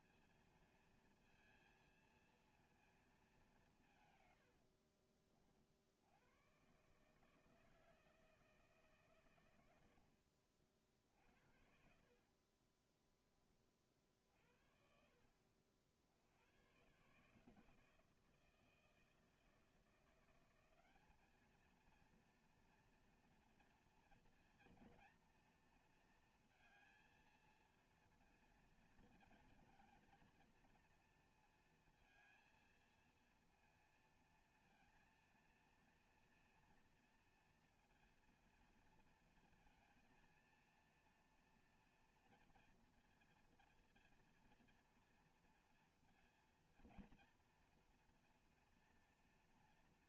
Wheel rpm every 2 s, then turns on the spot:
230, 230, 110, 110, 160, 60, 50, 60, 90, 160, 180, 230, 230, 230, 230, 230, 230, 230, 230, 230, 230, 230, 230, 230, 240.
12-14